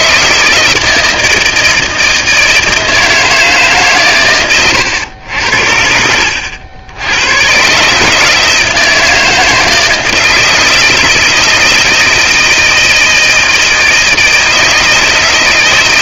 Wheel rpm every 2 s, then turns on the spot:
160, 160, 120, 80, 160, 160, 160, 160.
4-6